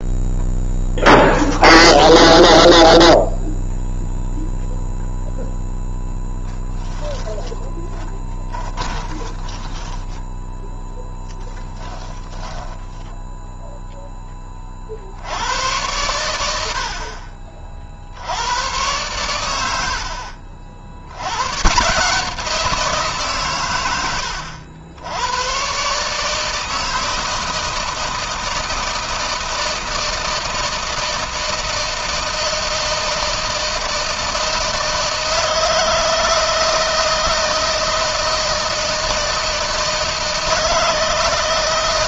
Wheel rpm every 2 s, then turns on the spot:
0, 0, 0, 10, 20, 10, 10, 60, 60, 110, 80, 160, 90, 160, 160, 160, 160, 160, 160, 160, 160.
6-10